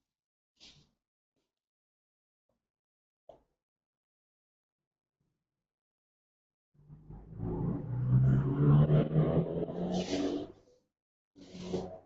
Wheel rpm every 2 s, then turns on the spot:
0, 0, 0, 0, 0, 0.
none